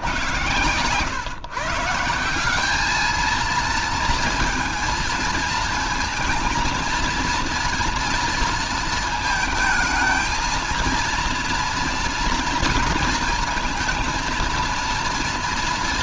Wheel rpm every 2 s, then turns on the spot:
140, 190, 220, 230, 230, 230, 230, 230.
none